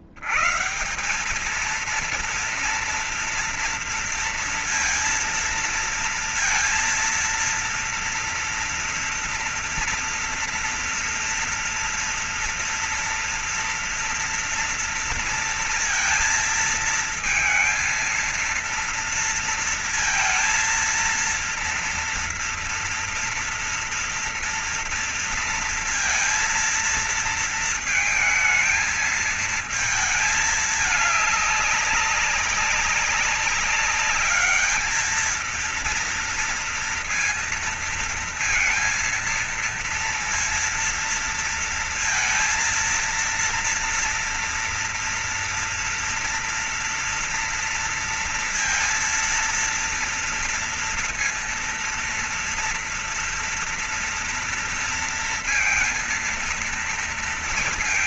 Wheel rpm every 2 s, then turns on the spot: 90, 230, 230, 230, 230, 230, 230, 230, 230, 230, 230, 230, 230, 230, 220, 220, 200, 200, 230, 230, 230, 230, 240, 240, 230, 230, 230, 230, 230.
none